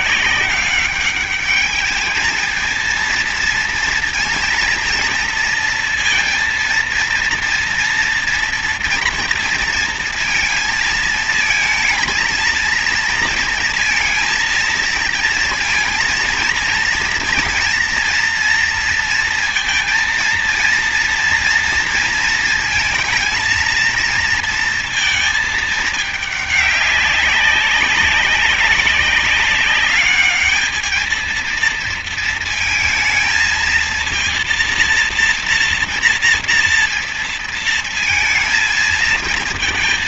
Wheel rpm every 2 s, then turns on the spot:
190, 220, 230, 230, 230, 230, 230, 230, 230, 230, 230, 230, 230, 200, 190, 210, 230, 230, 230, 220.
none